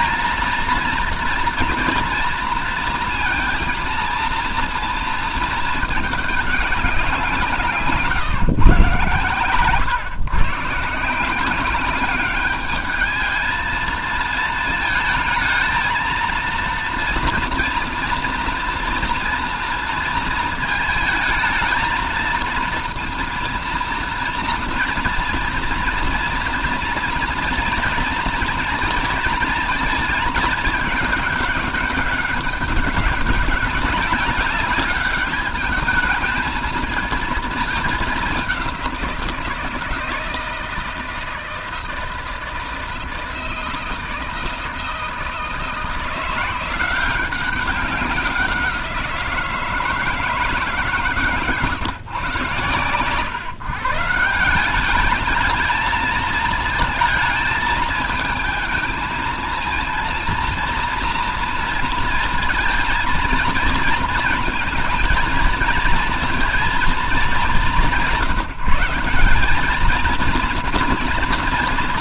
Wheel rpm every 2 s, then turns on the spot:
230, 230, 230, 200, 140, 140, 210, 220, 230, 230, 230, 230, 230, 230, 230, 220, 200, 200, 220, 190, 160, 160, 160, 170, 180, 150, 120, 180, 220, 220, 230, 230, 230, 230, 170, 230.
none